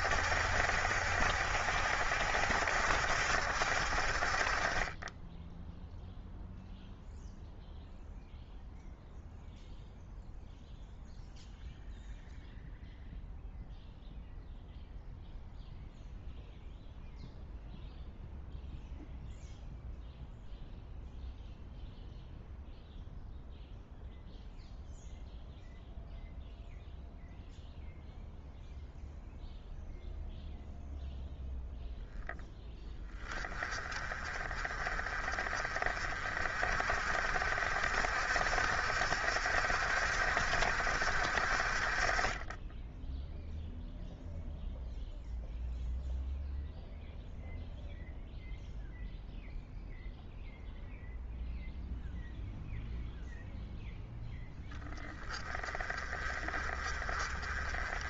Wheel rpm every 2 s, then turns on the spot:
70, 70, 30, 0, 0, 0, 0, 0, 0, 0, 0, 0, 0, 0, 0, 0, 10, 40, 50, 60, 60, 10, 0, 0, 0, 0, 0, 10, 30.
none